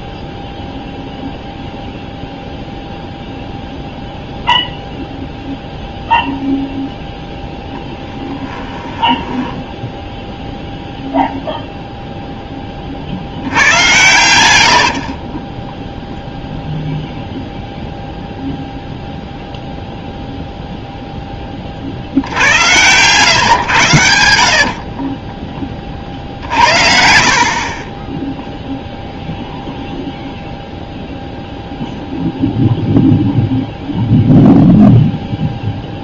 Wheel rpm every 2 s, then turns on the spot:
0, 0, 0, 0, 10, 0, 30, 80, 0, 0, 0, 100, 50, 70, 0, 0, 0, 0.
8-10 14-16 24-28